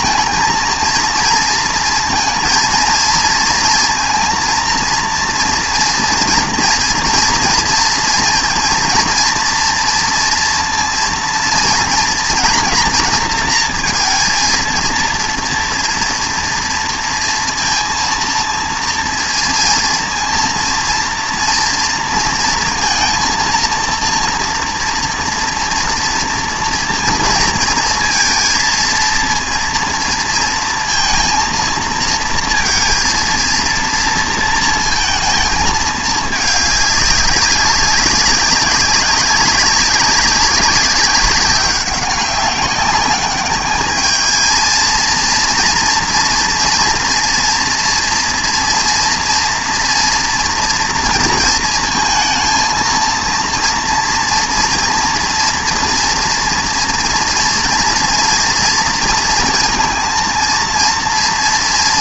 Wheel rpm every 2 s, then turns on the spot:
220, 230, 230, 230, 230, 230, 240, 230, 230, 230, 230, 230, 240, 230, 230, 230, 230, 230, 210, 190, 190, 190, 220, 230, 230, 240, 230, 230, 240, 230, 230.
none